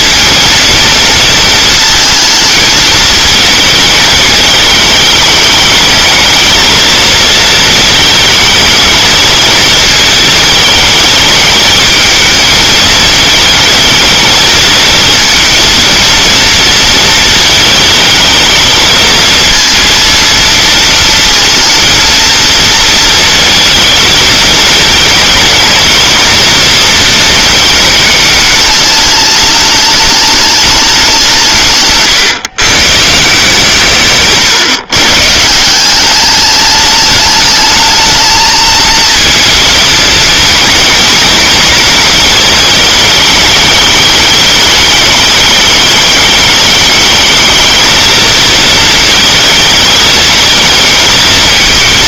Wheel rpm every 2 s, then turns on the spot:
230, 220, 210, 220, 220, 210, 220, 220, 230, 220, 230, 230, 220, 230, 210, 200, 140, 150, 210, 230, 230, 210, 210, 210, 220, 220.
none